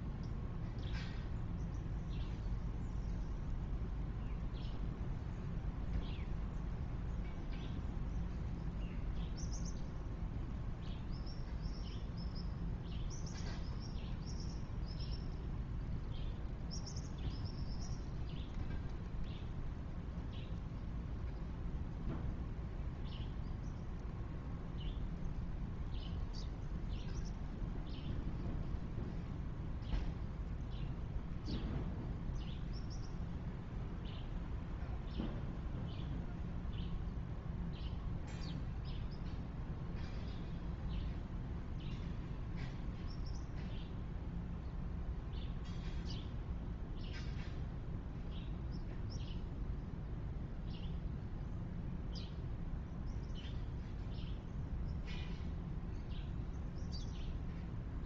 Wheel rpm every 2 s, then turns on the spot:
0, 0, 0, 0, 0, 0, 0, 0, 0, 0, 0, 0, 0, 0, 0, 0, 0, 0, 0, 0, 0, 0, 0, 0, 0, 0, 0, 0, 0.
none